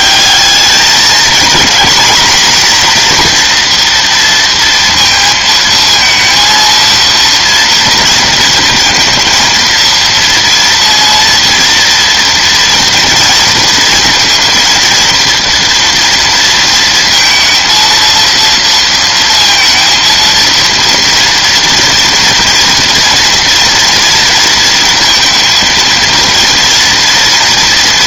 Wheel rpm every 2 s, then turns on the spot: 210, 240, 230, 230, 230, 230, 230, 230, 230, 230, 230, 230, 230, 230.
none